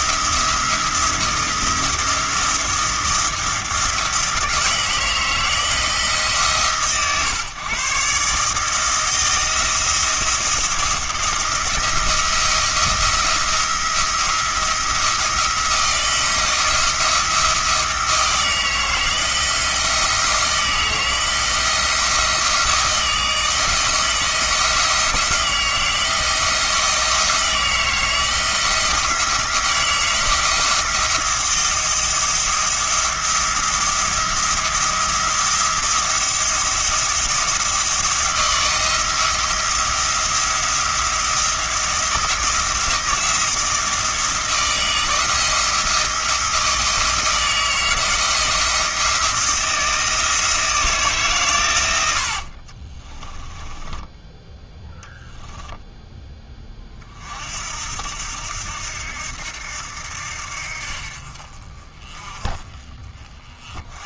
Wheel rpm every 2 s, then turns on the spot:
170, 170, 170, 140, 160, 170, 170, 170, 170, 160, 170, 160, 170, 160, 170, 170, 170, 170, 170, 170, 170, 170, 170, 160, 170, 160, 40, 10, 30, 80, 60, 30.
52-56